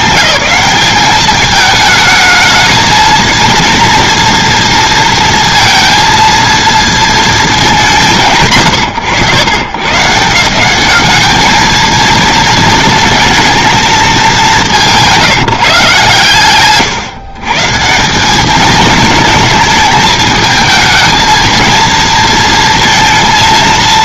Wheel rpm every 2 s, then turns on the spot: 180, 220, 230, 230, 150, 190, 220, 200, 130, 220, 220, 230.
none